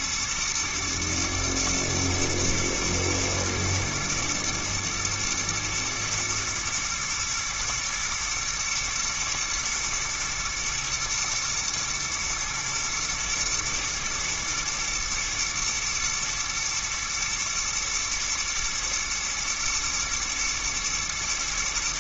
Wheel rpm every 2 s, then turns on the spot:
120, 120, 110, 110, 110, 120, 110, 110, 120, 120, 110.
none